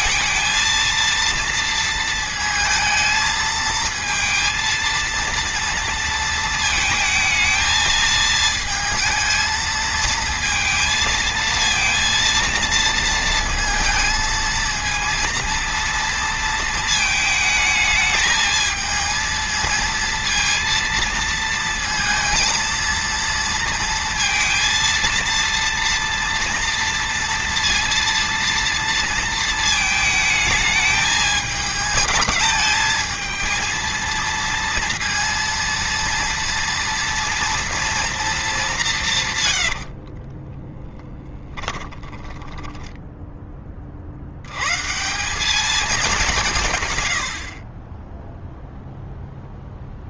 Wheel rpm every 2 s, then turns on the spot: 230, 220, 230, 220, 220, 220, 230, 230, 220, 220, 230, 230, 230, 230, 230, 210, 220, 230, 230, 170, 10, 10, 130, 130, 0.
40-44